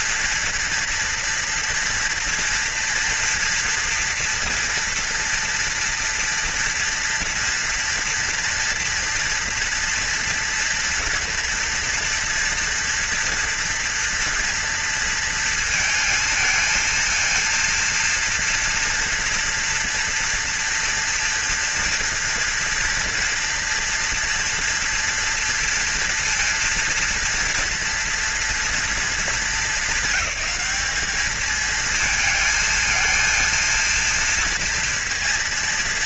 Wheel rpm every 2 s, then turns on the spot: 230, 230, 230, 230, 230, 230, 230, 230, 230, 230, 230, 230, 230, 230, 230, 220, 230, 230.
none